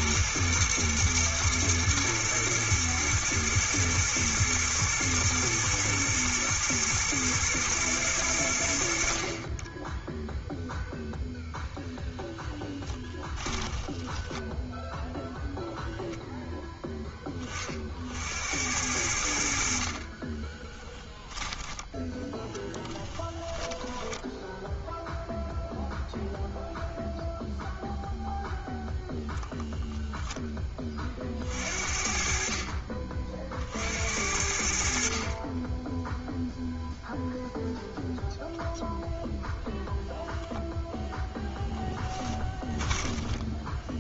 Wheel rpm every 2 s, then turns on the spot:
110, 120, 120, 110, 70, 0, 20, 10, 10, 80, 10, 10, 0, 0, 0, 20, 40, 60, 0, 0, 0, 10.
12-16 22-24 42-44